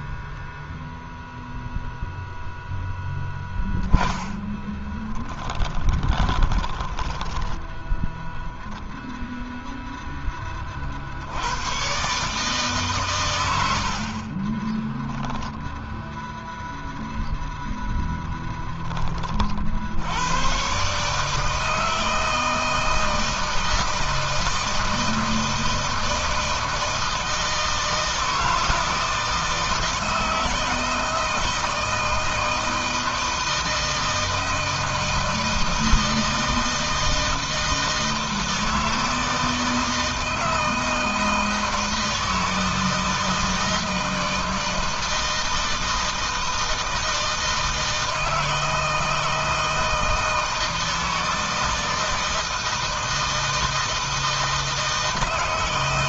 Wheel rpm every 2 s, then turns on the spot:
0, 0, 10, 10, 10, 30, 140, 30, 0, 10, 120, 160, 160, 160, 160, 160, 160, 160, 160, 160, 160, 160, 160, 160, 160, 160, 160, 160.
4-8 14-16